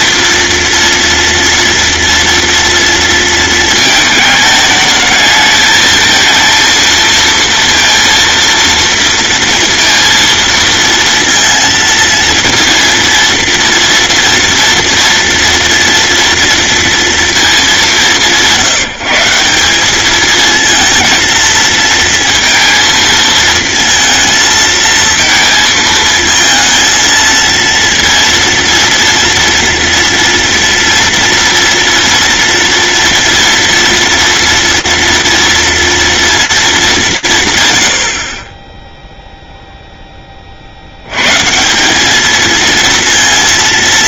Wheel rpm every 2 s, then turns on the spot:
230, 230, 220, 230, 230, 230, 230, 230, 230, 170, 220, 230, 220, 230, 230, 230, 230, 230, 200, 10, 90, 230.
none